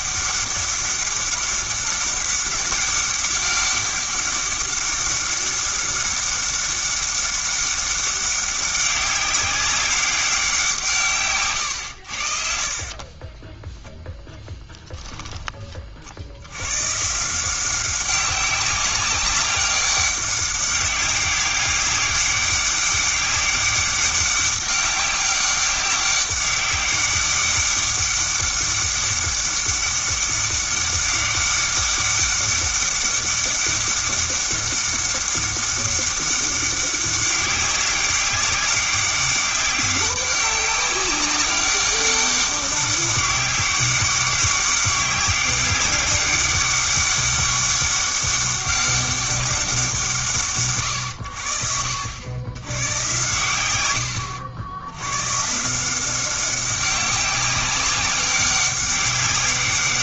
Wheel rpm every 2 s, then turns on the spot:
200, 200, 200, 200, 200, 160, 40, 10, 130, 190, 200, 200, 200, 200, 200, 200, 200, 200, 200, 200, 190, 200, 200, 200, 200, 130, 100, 90, 190, 200.
12-14